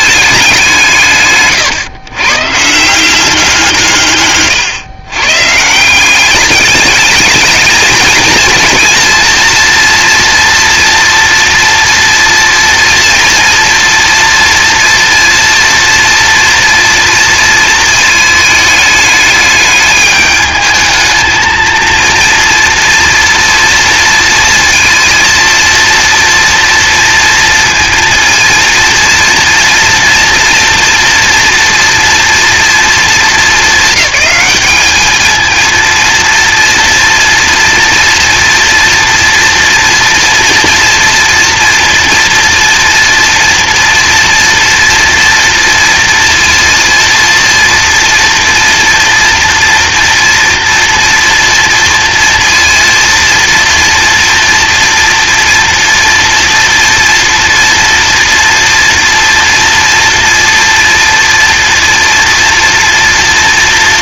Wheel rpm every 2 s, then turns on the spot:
180, 160, 120, 210, 230, 230, 230, 230, 230, 210, 220, 230, 230, 230, 230, 230, 230, 210, 230, 230, 230, 230, 230, 230, 240, 240, 230, 230, 240, 230, 230, 230.
none